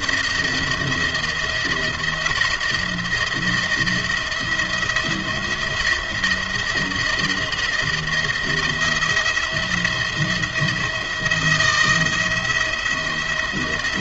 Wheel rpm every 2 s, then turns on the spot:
170, 170, 170, 170, 170, 170, 170.
none